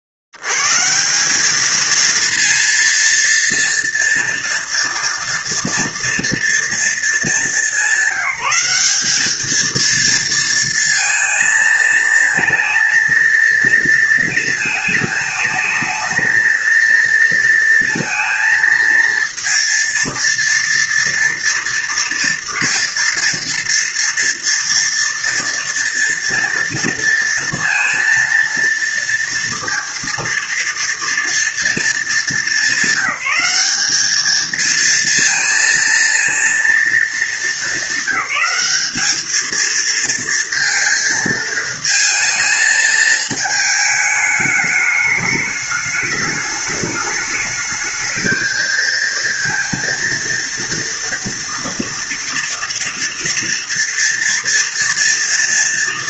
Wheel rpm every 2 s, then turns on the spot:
60, 230, 230, 230, 190, 230, 230, 220, 230, 230, 230, 230, 230, 230, 230, 230, 200, 230, 230, 210, 230, 220, 210, 210, 220, 230, 230, 230.
none